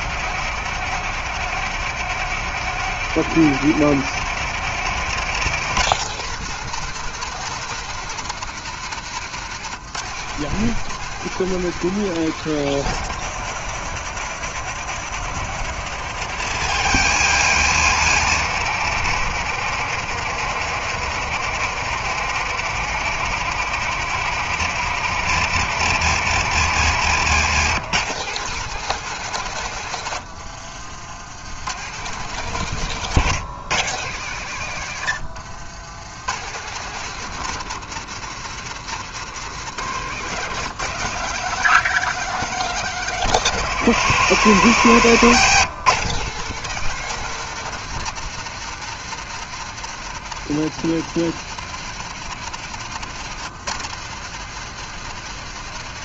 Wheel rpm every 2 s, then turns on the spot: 170, 170, 170, 180, 150, 180, 160, 160, 150, 160, 160, 160, 160, 150, 160, 80, 140, 90, 170, 150, 160, 170, 130, 180, 160, 160, 150, 160.
32-34 44-46